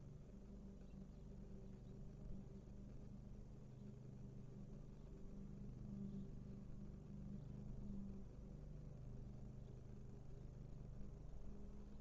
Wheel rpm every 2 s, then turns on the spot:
0, 0, 0, 0, 0, 0.
none